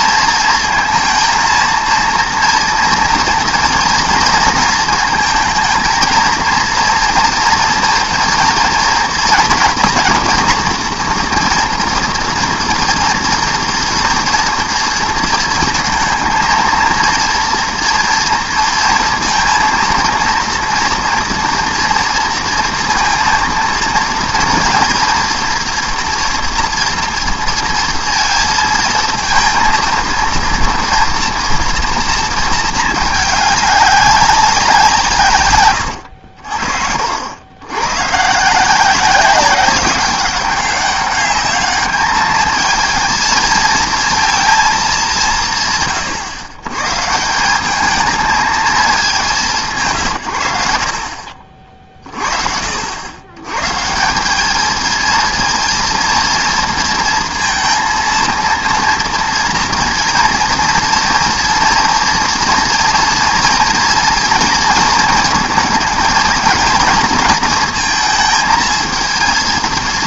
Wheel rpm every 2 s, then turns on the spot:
230, 230, 220, 230, 230, 230, 230, 230, 230, 230, 230, 230, 230, 230, 230, 230, 220, 180, 60, 170, 200, 220, 220, 130, 220, 70, 70, 220, 230, 230, 240, 230, 230, 230, 220.
36-38